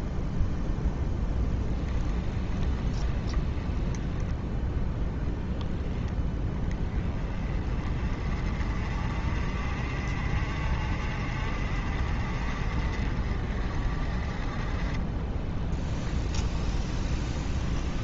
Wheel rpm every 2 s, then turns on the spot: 0, 20, 10, 20, 40, 40, 40, 30, 20.
2-4 16-18